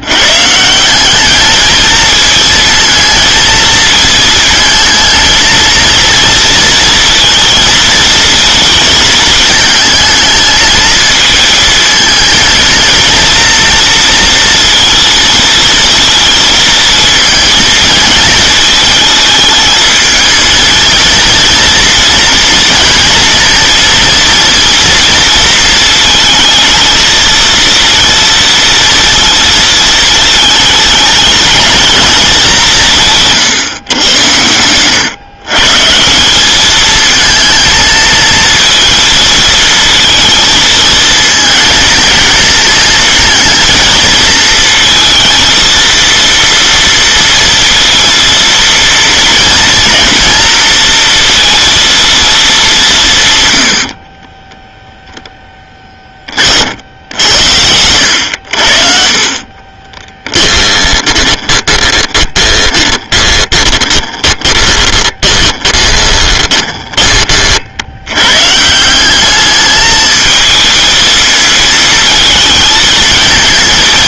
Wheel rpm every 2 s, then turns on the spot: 160, 220, 220, 230, 220, 220, 230, 230, 230, 220, 220, 230, 230, 230, 230, 220, 190, 110, 210, 230, 220, 230, 230, 230, 230, 230, 200, 10, 60, 70, 20, 20, 20, 20, 160, 220, 220.
60-68